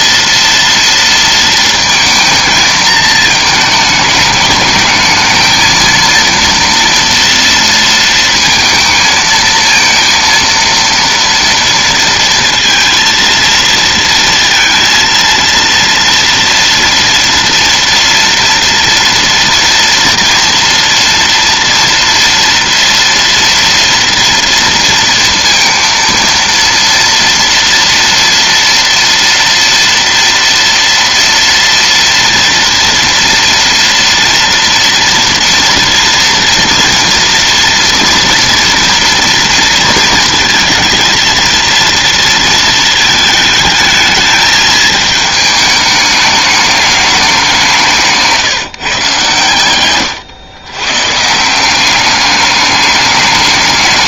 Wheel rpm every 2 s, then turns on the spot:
230, 220, 220, 230, 220, 230, 230, 230, 230, 230, 230, 230, 230, 230, 230, 240, 230, 230, 230, 230, 230, 220, 220, 210, 140, 130, 210.
none